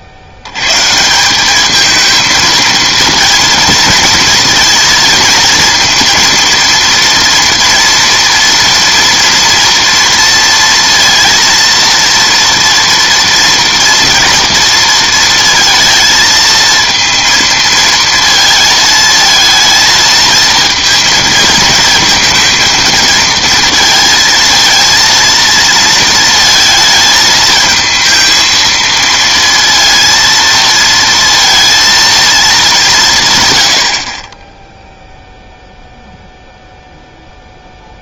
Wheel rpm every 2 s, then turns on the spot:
110, 230, 230, 230, 230, 230, 230, 230, 230, 220, 230, 230, 230, 220, 230, 230, 200, 10, 0.
none